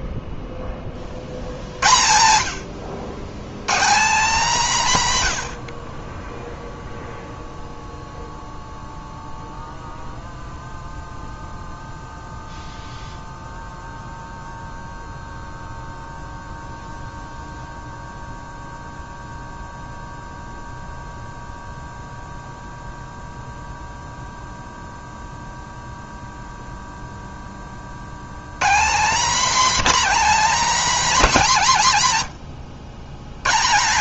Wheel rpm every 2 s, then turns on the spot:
30, 100, 170, 0, 0, 0, 0, 0, 0, 0, 0, 0, 0, 0, 180, 240, 100.
none